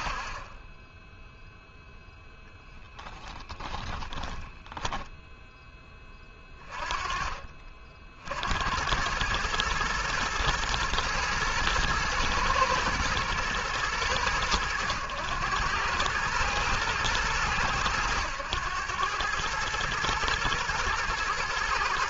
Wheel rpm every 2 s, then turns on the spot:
0, 0, 10, 40, 110, 110, 110, 100, 100, 110, 120.
none